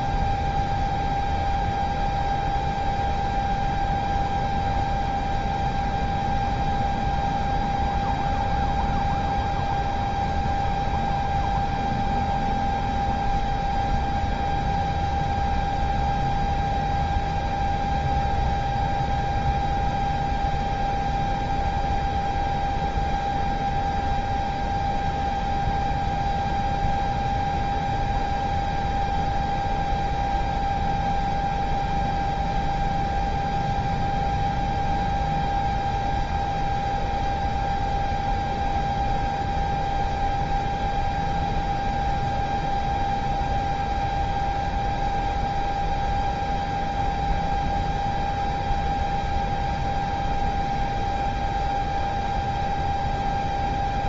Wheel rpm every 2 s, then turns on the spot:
0, 0, 0, 0, 0, 0, 0, 0, 0, 0, 0, 0, 0, 0, 0, 0, 0, 0, 0, 0, 0, 0, 0, 0, 0, 0, 0.
none